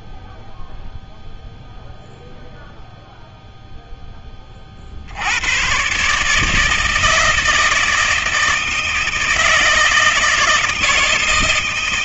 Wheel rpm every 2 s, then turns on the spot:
0, 0, 30, 150, 160, 160.
none